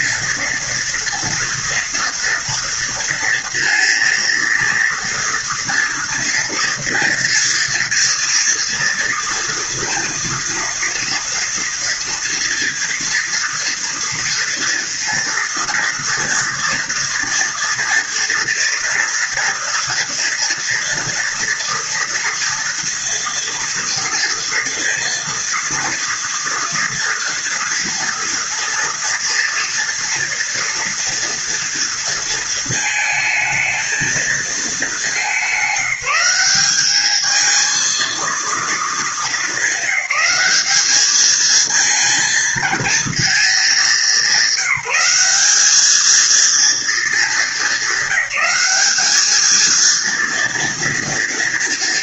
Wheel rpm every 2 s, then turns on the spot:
240, 230, 230, 230, 230, 230, 230, 230, 230, 230, 230, 230, 230, 230, 230, 240, 220, 210, 200, 220, 210, 230, 200, 220, 200, 230.
none